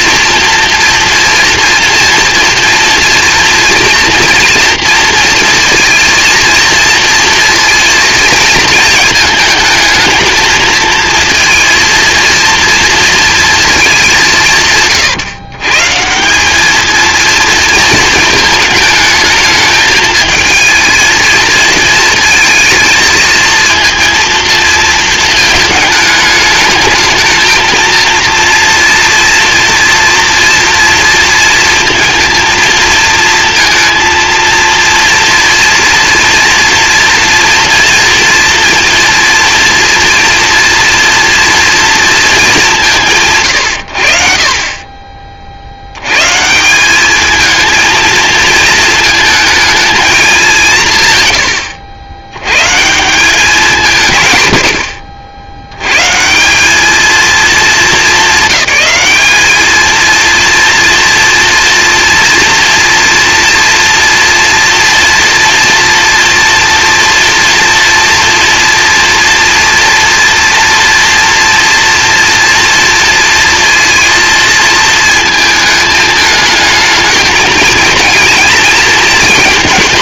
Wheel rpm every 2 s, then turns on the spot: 240, 230, 230, 230, 220, 230, 230, 140, 220, 220, 230, 220, 220, 220, 230, 230, 230, 230, 230, 230, 240, 170, 30, 190, 230, 150, 160, 70, 210, 210, 240, 230, 230, 230, 230, 230, 230, 220, 220, 220.
none